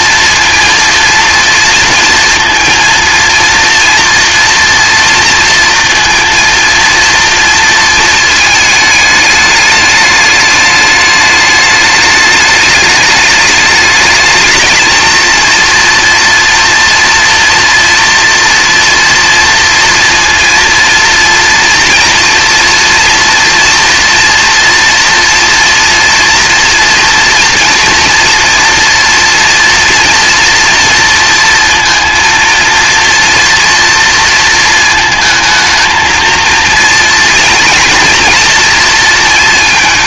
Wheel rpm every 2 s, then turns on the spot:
230, 230, 230, 230, 220, 210, 210, 230, 230, 240, 240, 230, 230, 230, 240, 230, 230, 220, 230, 230.
none